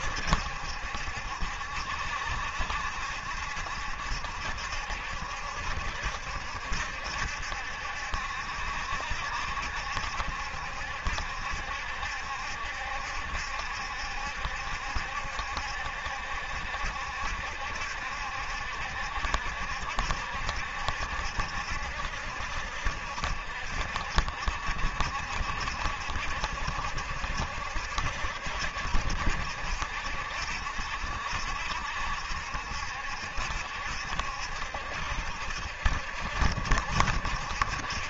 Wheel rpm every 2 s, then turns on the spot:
70, 70, 70, 70, 70, 70, 70, 70, 70, 70, 70, 60, 60, 70, 70, 70, 70, 70, 70.
none